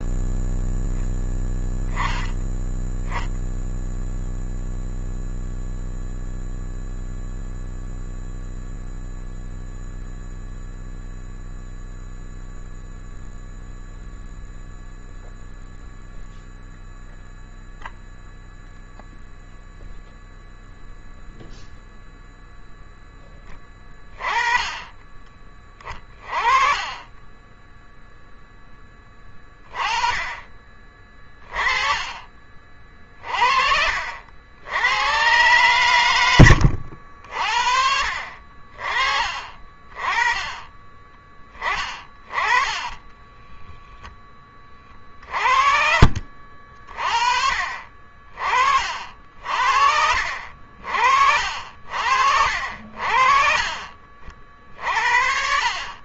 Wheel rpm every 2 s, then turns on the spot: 0, 10, 0, 0, 0, 0, 0, 0, 0, 0, 0, 0, 20, 30, 10, 20, 40, 70, 90, 50, 20, 20, 20, 40, 50, 60, 60, 50.
42-44